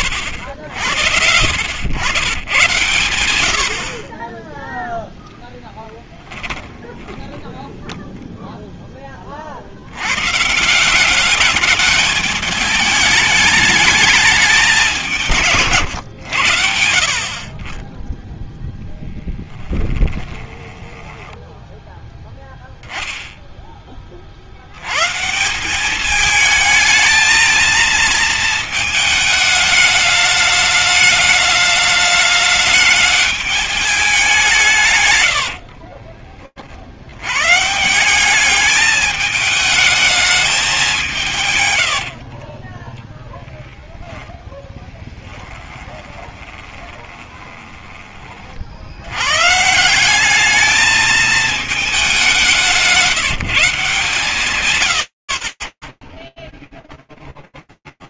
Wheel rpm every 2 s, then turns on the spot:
100, 110, 10, 10, 0, 140, 210, 200, 90, 10, 10, 0, 50, 220, 220, 210, 210, 180, 60, 210, 210, 40, 10, 20, 60, 210, 180, 80, 0.
20-22 42-48 54-56